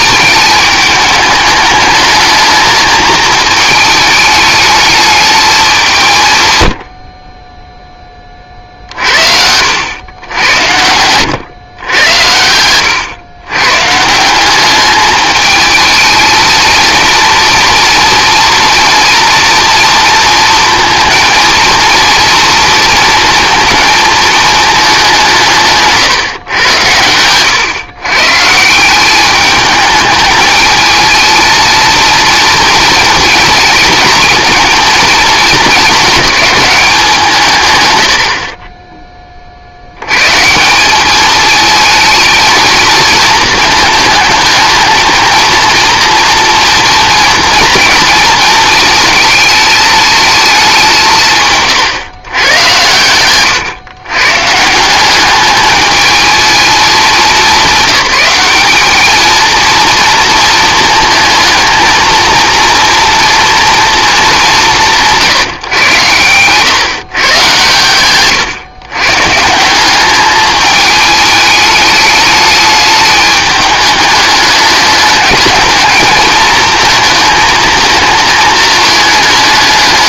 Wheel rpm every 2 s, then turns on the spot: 210, 220, 220, 110, 40, 90, 90, 200, 220, 230, 230, 230, 220, 120, 160, 220, 230, 230, 210, 30, 170, 230, 220, 230, 220, 210, 120, 160, 220, 200, 230, 230, 200, 130, 130, 210, 210, 210, 220, 220.
8-10 12-14